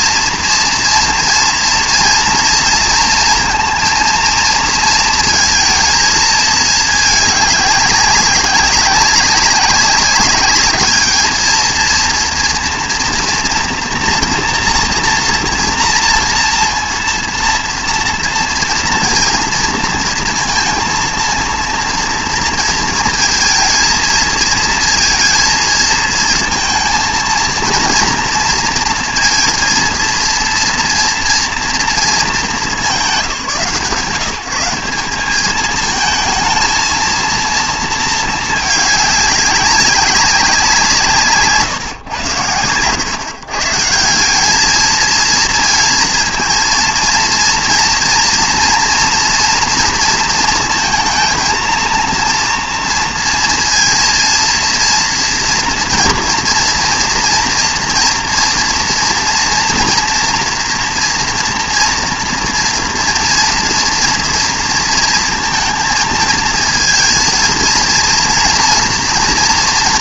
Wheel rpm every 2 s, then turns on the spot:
230, 230, 230, 210, 190, 210, 230, 240, 230, 230, 230, 230, 220, 230, 230, 230, 150, 180, 230, 210, 170, 100, 220, 230, 230, 230, 230, 230, 230, 230, 230, 240, 230, 230, 230.
42-44